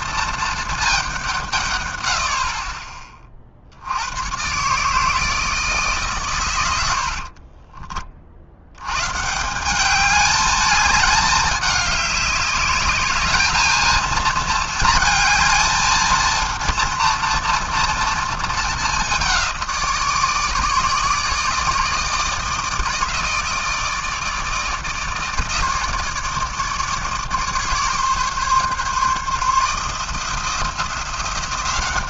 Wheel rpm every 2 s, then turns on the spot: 220, 30, 140, 90, 90, 210, 200, 220, 230, 210, 160, 160, 150, 150, 140, 170.
none